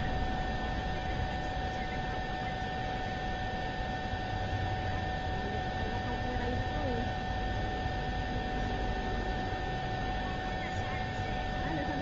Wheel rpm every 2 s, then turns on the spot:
0, 0, 0, 0, 0, 0.
none